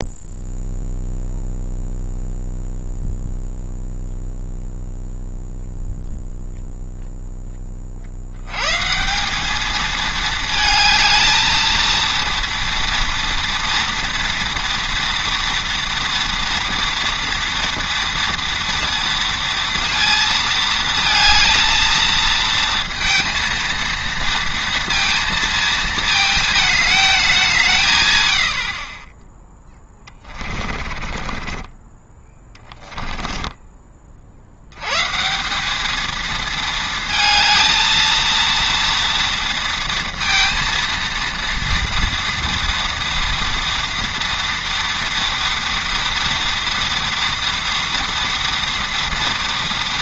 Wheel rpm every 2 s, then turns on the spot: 0, 0, 0, 0, 140, 220, 230, 230, 230, 230, 220, 230, 230, 220, 50, 30, 10, 100, 220, 230, 230, 230, 230, 230, 230.
30-34